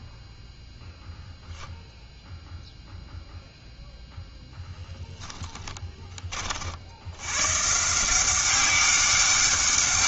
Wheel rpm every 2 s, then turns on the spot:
0, 0, 0, 50, 190.
none